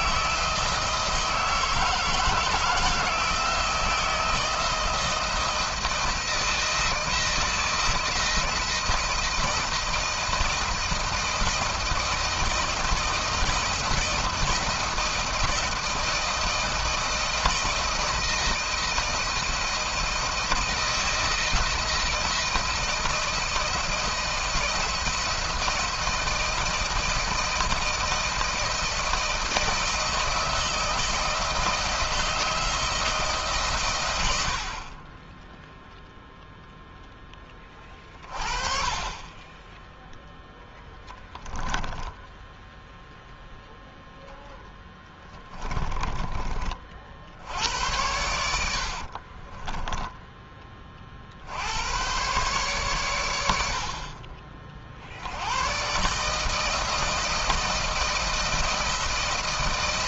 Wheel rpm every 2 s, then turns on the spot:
160, 160, 160, 170, 160, 160, 170, 170, 170, 160, 160, 170, 170, 160, 160, 160, 160, 50, 0, 40, 10, 10, 10, 40, 80, 30, 130, 50, 160, 160.
44-46 48-50